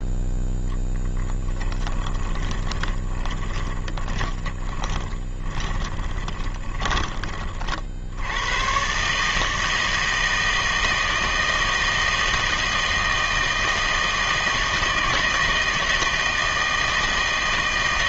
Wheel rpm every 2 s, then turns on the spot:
0, 20, 20, 20, 110, 160, 160, 160, 160.
2-8